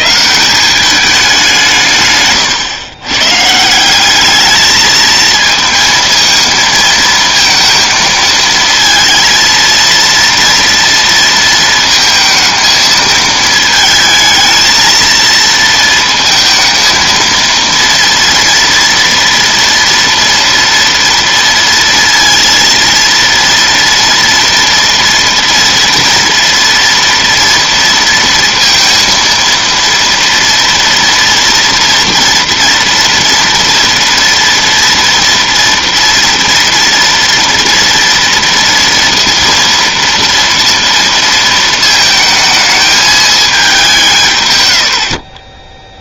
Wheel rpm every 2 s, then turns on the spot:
190, 120, 220, 230, 230, 230, 220, 220, 220, 230, 230, 230, 240, 230, 230, 230, 240, 230, 230, 230, 230, 220, 70.
none